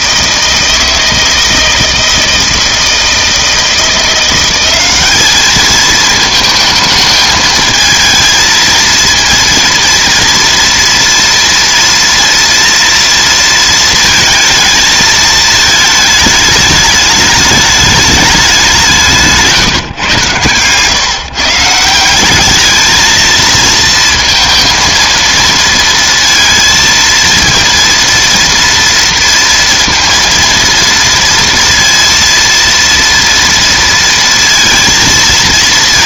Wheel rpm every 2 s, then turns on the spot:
160, 160, 190, 220, 230, 230, 230, 230, 210, 190, 130, 210, 230, 230, 230, 230, 230, 230.
none